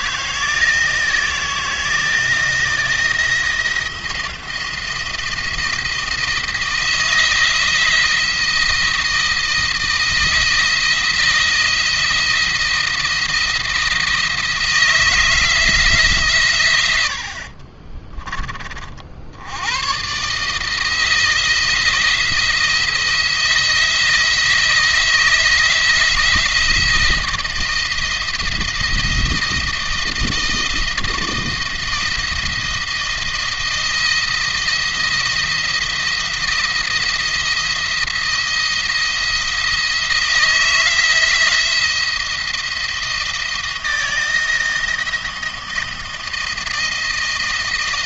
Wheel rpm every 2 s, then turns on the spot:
160, 170, 170, 160, 170, 170, 170, 160, 110, 40, 160, 170, 160, 160, 170, 160, 170, 170, 170, 170, 160, 170, 160, 170.
none